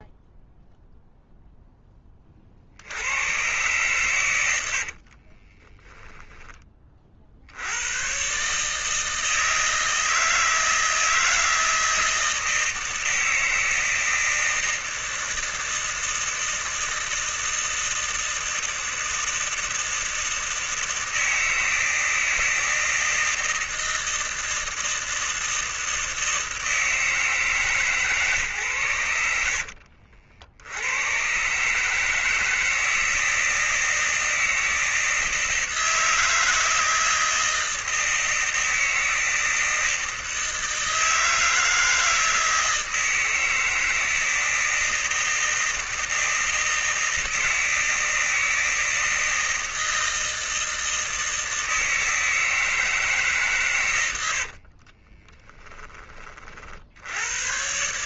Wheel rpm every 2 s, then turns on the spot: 0, 90, 50, 50, 160, 160, 160, 160, 160, 160, 160, 160, 160, 160, 100, 110, 160, 160, 160, 160, 160, 160, 160, 160, 160, 160, 150, 30, 90.
4-6 54-56